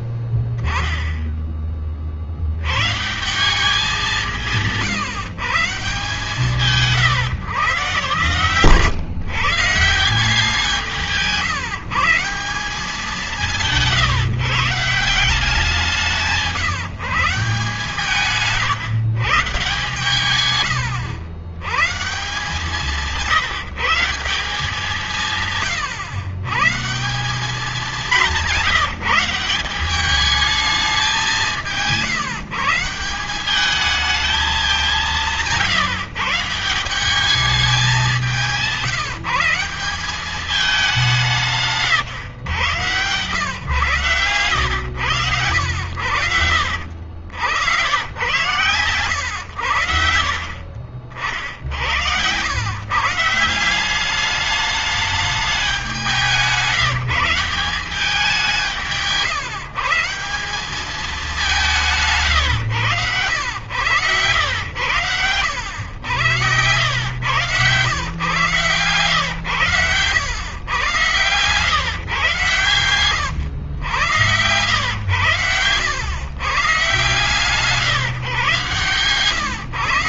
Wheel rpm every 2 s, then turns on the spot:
10, 150, 130, 150, 140, 160, 190, 190, 150, 160, 100, 170, 180, 180, 180, 190, 180, 180, 190, 170, 190, 120, 100, 80, 120, 70, 140, 210, 170, 160, 190, 120, 80, 90, 130, 110, 120, 100, 130, 130.
72-74 78-80